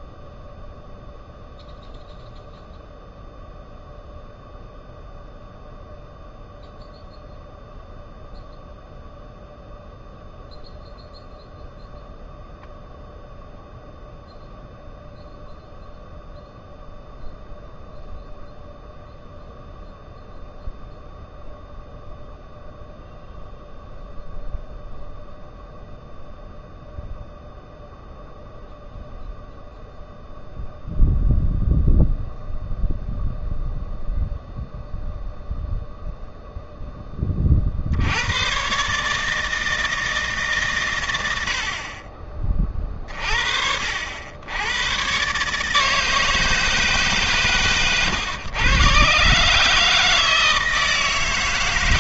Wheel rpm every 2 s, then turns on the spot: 0, 0, 0, 0, 0, 0, 0, 0, 0, 0, 0, 0, 0, 0, 0, 0, 0, 0, 0, 110, 150, 40, 90, 160, 120, 160.
none